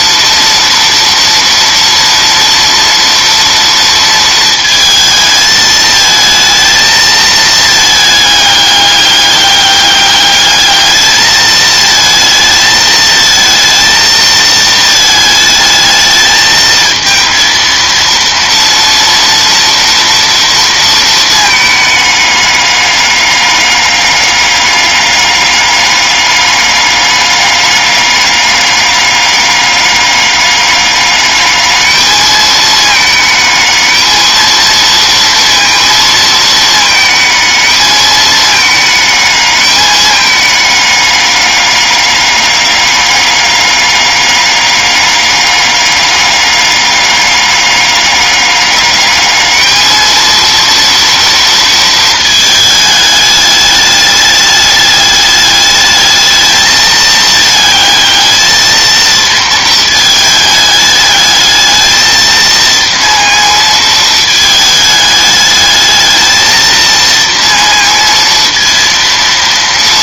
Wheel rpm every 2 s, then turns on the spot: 230, 240, 220, 220, 210, 210, 220, 220, 220, 230, 230, 200, 200, 200, 200, 200, 220, 230, 220, 210, 210, 200, 200, 200, 200, 230, 220, 210, 220, 220, 210, 230, 220, 220, 230.
none